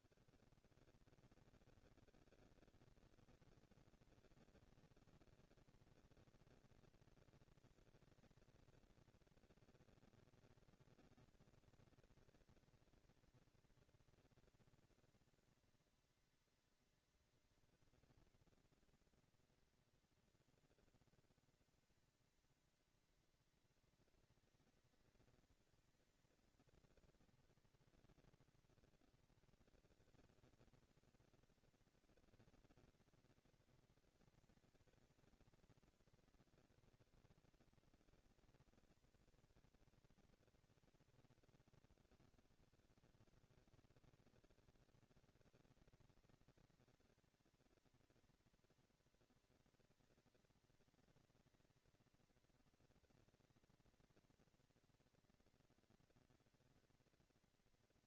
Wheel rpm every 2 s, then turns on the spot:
150, 220, 230, 230, 230, 230, 220, 230, 230, 240, 230, 230, 230, 230, 230, 230, 230, 230, 230, 220, 220, 200, 200, 200, 220, 230, 230, 230, 230.
none